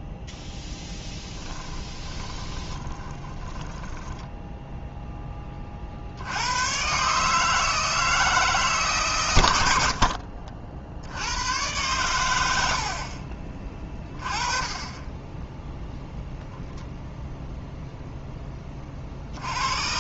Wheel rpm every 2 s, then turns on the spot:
10, 20, 10, 130, 140, 80, 60, 20, 0, 50.
0-4 12-14